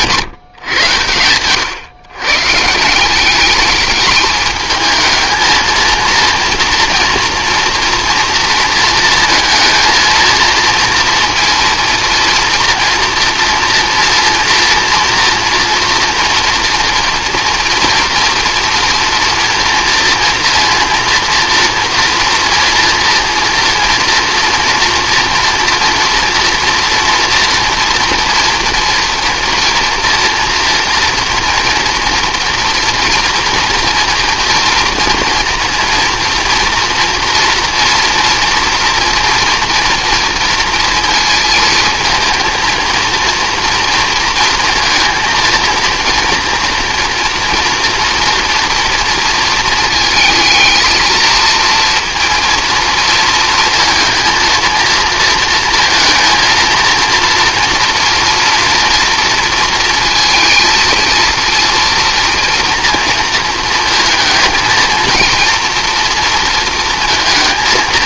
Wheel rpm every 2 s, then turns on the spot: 120, 160, 220, 230, 230, 230, 230, 230, 230, 240, 230, 230, 230, 230, 230, 230, 240, 230, 230, 230, 230, 230, 230, 240, 230, 230, 230, 230, 230, 230, 230, 230, 230, 230.
none